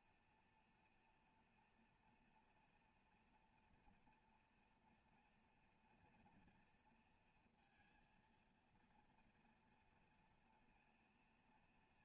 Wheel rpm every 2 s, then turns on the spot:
240, 240, 230, 230, 230, 230.
none